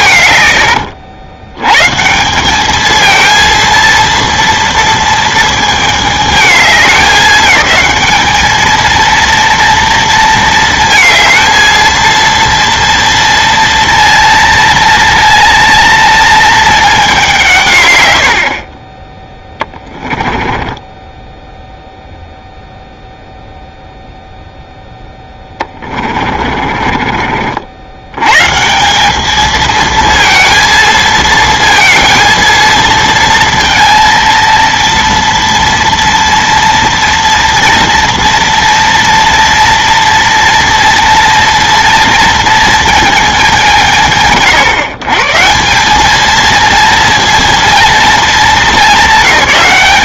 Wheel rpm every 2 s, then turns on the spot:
110, 200, 230, 210, 220, 230, 230, 230, 220, 40, 10, 0, 0, 30, 150, 230, 230, 230, 230, 230, 230, 230, 120, 230, 220.
0-2 20-22 26-28